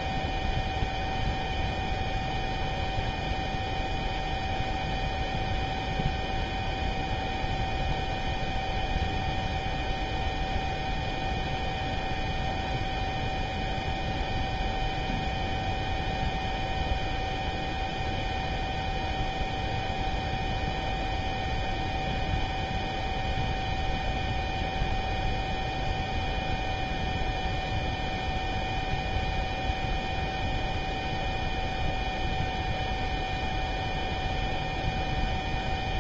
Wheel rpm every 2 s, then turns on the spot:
0, 0, 0, 0, 0, 0, 0, 0, 0, 0, 0, 0, 0, 0, 0, 0, 0, 0.
none